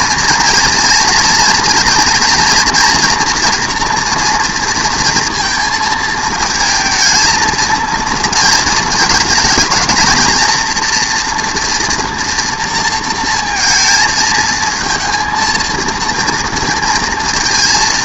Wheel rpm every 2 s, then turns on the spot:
230, 230, 230, 230, 220, 230, 230, 220, 230.
none